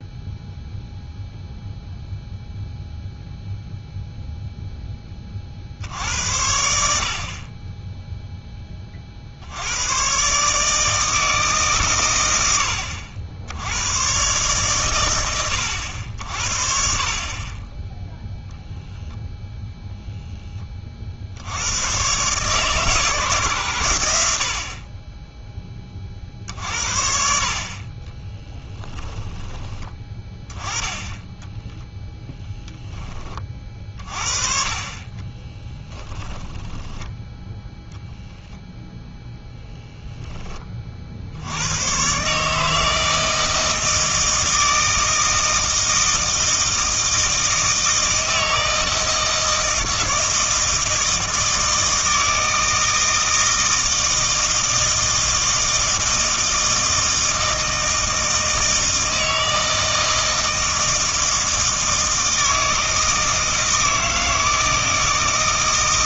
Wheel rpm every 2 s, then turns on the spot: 0, 0, 0, 70, 20, 150, 100, 120, 60, 0, 30, 150, 50, 50, 10, 10, 10, 40, 20, 0, 30, 150, 160, 160, 160, 160, 160, 160, 160, 160, 160, 160, 160.
28-30 36-38